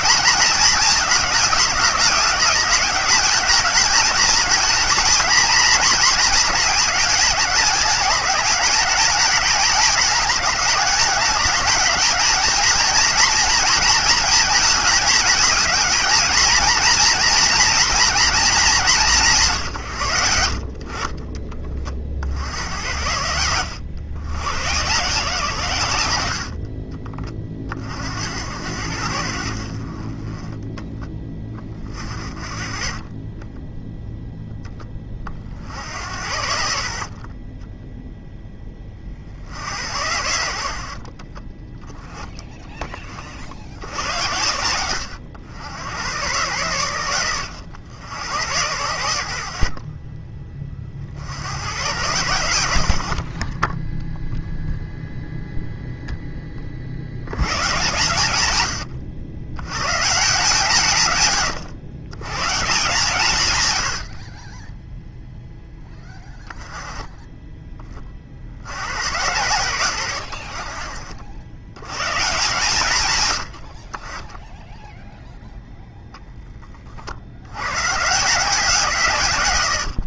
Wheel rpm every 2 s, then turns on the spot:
220, 200, 220, 220, 210, 200, 220, 220, 230, 210, 70, 70, 120, 50, 80, 10, 30, 10, 70, 10, 70, 20, 90, 110, 90, 30, 90, 0, 30, 100, 160, 130, 10, 10, 80, 60, 140, 0, 20, 170.
none